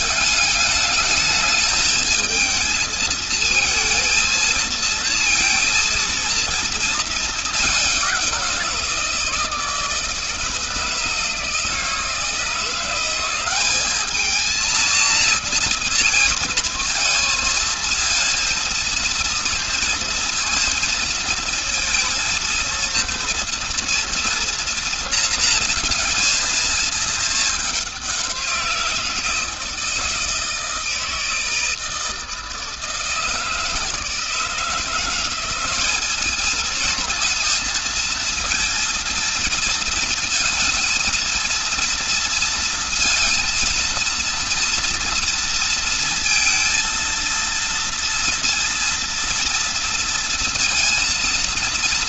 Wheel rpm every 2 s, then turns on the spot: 220, 220, 230, 220, 170, 160, 180, 230, 220, 230, 230, 230, 230, 220, 170, 160, 160, 170, 220, 230, 230, 230, 230, 230, 230, 230.
none